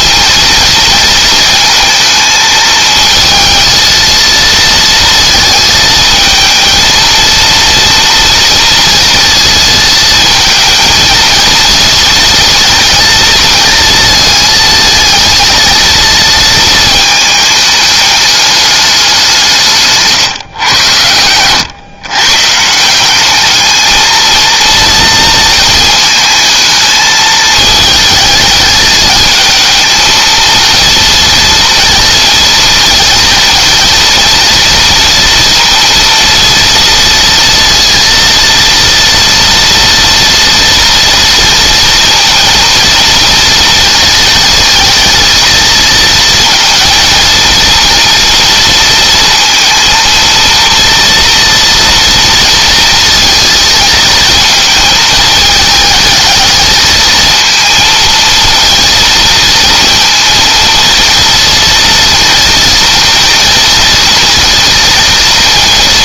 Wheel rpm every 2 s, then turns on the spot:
230, 220, 230, 220, 230, 220, 230, 220, 230, 210, 120, 150, 230, 220, 220, 230, 220, 230, 230, 230, 230, 230, 230, 230, 230, 230, 230, 220, 220, 230, 230, 230, 230.
none